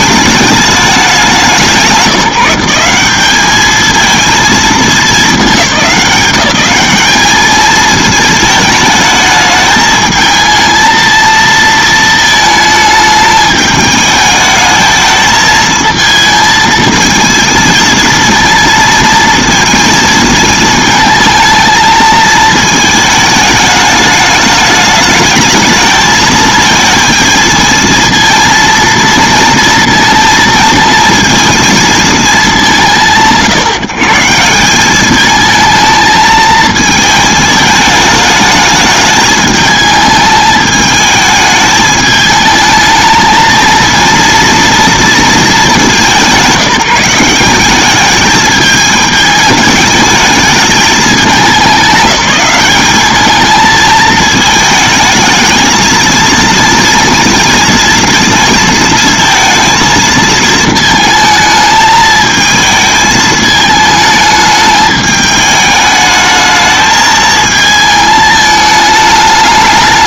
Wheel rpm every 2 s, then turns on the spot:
210, 180, 220, 190, 220, 230, 220, 220, 220, 230, 220, 220, 210, 220, 230, 230, 190, 180, 220, 210, 220, 220, 230, 180, 210, 210, 200, 220, 230, 230, 220, 220, 210, 220, 210.
none